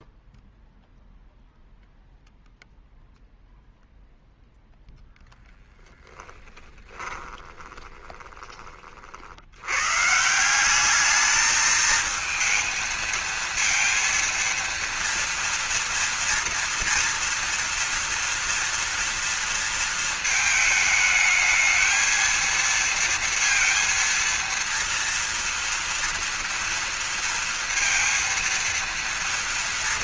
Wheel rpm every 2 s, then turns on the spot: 0, 0, 0, 20, 50, 200, 230, 230, 240, 230, 220, 230, 230, 230, 230.
6-8